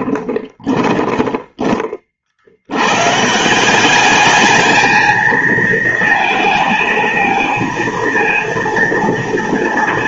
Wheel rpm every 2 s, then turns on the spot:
10, 70, 210, 220, 230.
0-2